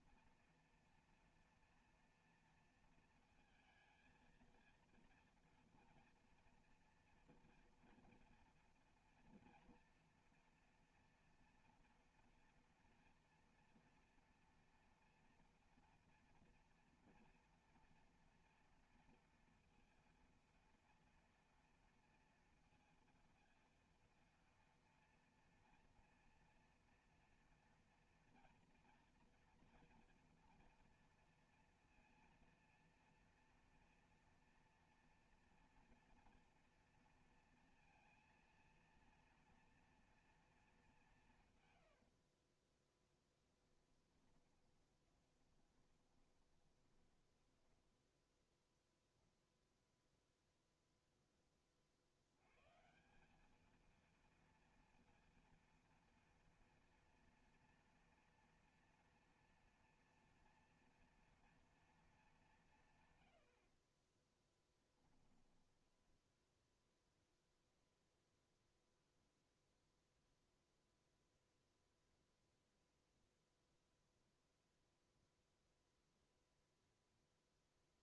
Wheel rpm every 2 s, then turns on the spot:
230, 230, 230, 230, 240, 230, 230, 230, 230, 230, 230, 230, 230, 240, 230, 230, 230, 230, 230, 230, 220, 20, 20, 30, 0, 0, 140, 230, 230, 240, 230, 150, 10, 0, 0, 0, 0, 0, 0.
42-48 64-66